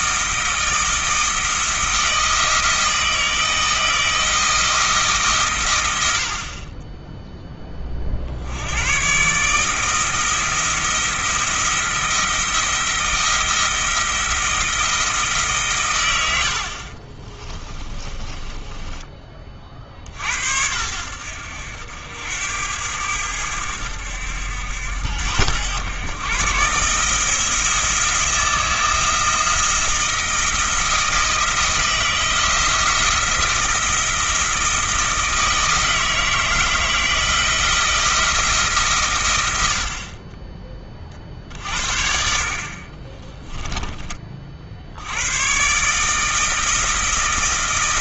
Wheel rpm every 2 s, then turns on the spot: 160, 160, 160, 30, 100, 170, 160, 170, 50, 20, 70, 90, 80, 140, 160, 170, 170, 160, 160, 150, 20, 40, 70, 160.
18-20 42-44